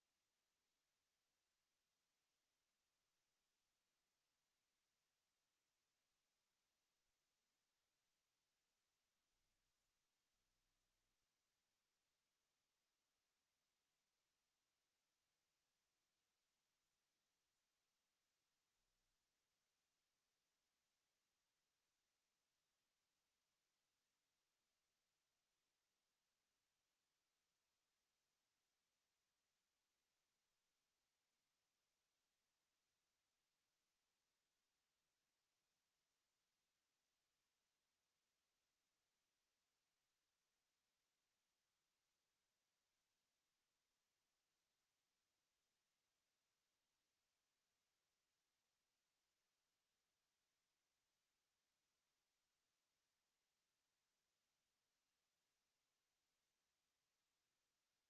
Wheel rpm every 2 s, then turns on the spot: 0, 0, 0, 0, 0, 0, 0, 0, 0, 0, 0, 0, 0, 0, 0, 0, 0, 0, 0, 0, 0, 0, 0, 0, 0, 0, 0, 0, 0.
none